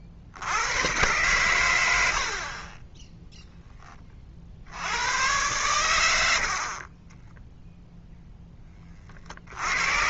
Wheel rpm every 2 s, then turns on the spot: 90, 30, 80, 40, 10.
2-4